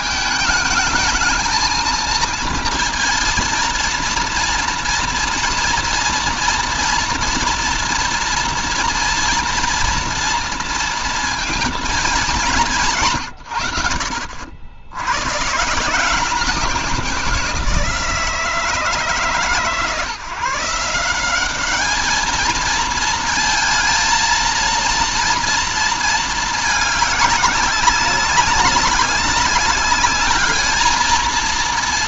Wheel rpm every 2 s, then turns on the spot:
220, 230, 230, 230, 230, 230, 210, 80, 180, 160, 150, 220, 230, 220, 190, 210.
none